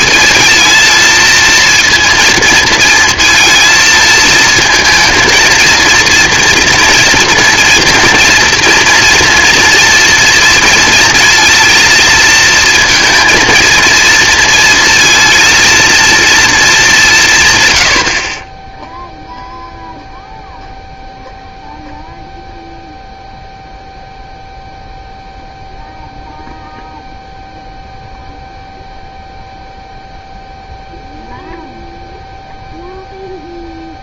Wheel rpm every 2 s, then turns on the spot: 230, 230, 230, 240, 240, 230, 230, 230, 220, 10, 0, 0, 0, 0, 0, 0, 0.
none